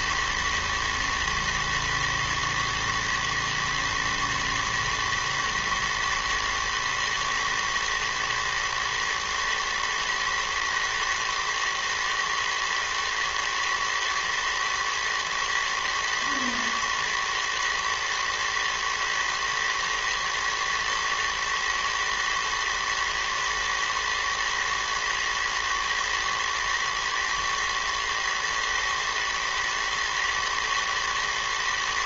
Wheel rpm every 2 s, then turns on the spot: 110, 120, 110, 110, 110, 110, 110, 110, 110, 110, 110, 110, 110, 120, 120, 110.
none